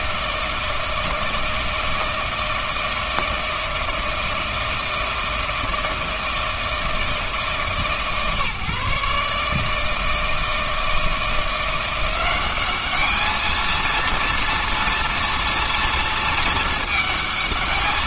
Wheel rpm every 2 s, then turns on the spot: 160, 160, 160, 160, 140, 160, 200, 230, 220.
none